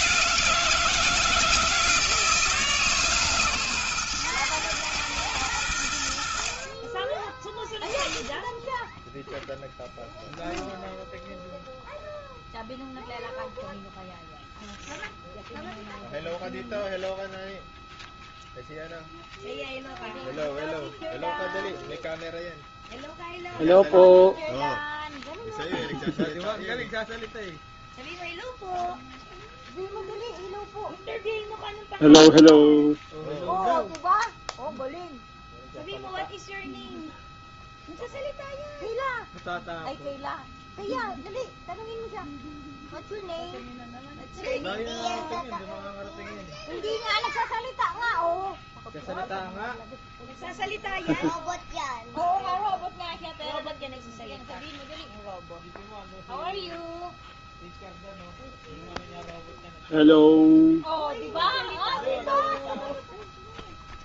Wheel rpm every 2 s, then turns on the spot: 180, 160, 120, 70, 10, 0, 0, 0, 0, 0, 0, 0, 0, 0, 0, 0, 0, 0, 0, 0, 0, 0, 0, 0, 0, 0, 0, 0, 0, 0, 0, 0.
none